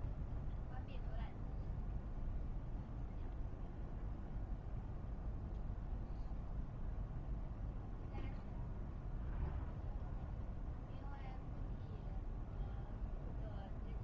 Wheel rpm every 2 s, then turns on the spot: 0, 0, 0, 0, 0, 0, 0.
none